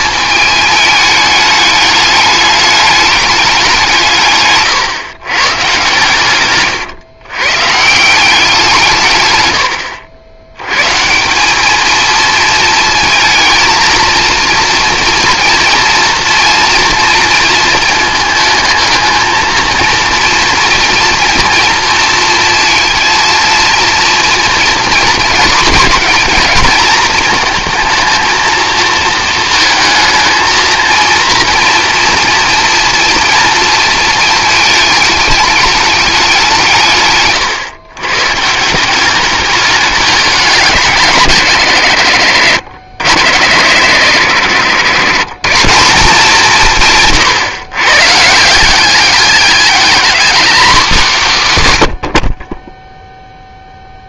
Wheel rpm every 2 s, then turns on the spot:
210, 210, 130, 140, 160, 130, 220, 230, 230, 220, 230, 230, 230, 230, 220, 230, 230, 210, 150, 170, 180, 120, 140, 150, 190, 200, 0.
none